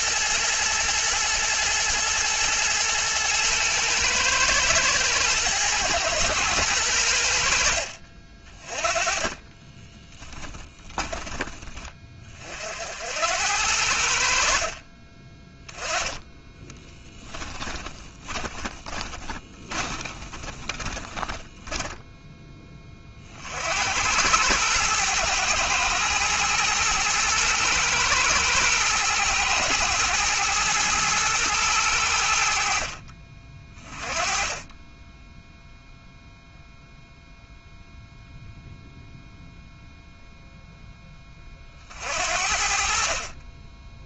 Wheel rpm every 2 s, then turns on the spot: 110, 110, 110, 90, 20, 20, 80, 30, 20, 20, 20, 30, 110, 120, 110, 110, 40, 10, 0, 0, 10, 40.
8-10 16-22